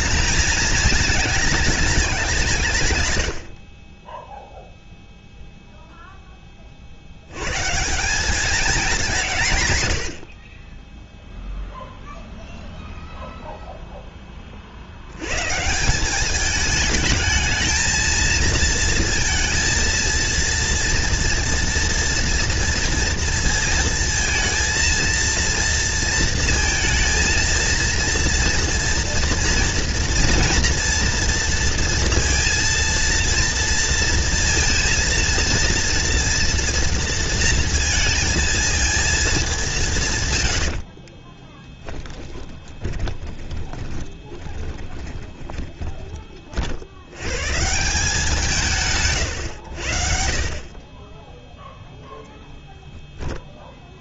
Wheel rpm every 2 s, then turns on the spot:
220, 70, 0, 60, 190, 0, 0, 90, 220, 230, 230, 230, 230, 230, 230, 230, 230, 230, 230, 220, 50, 20, 20, 70, 170, 30, 10.
40-46